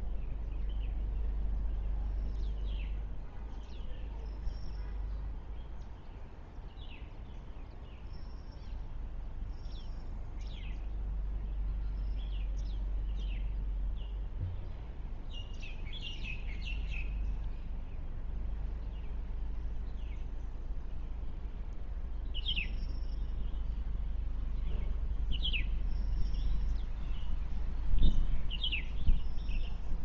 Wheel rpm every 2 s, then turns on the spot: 0, 0, 0, 0, 0, 0, 0, 0, 0, 0, 0, 0, 0, 0, 0.
none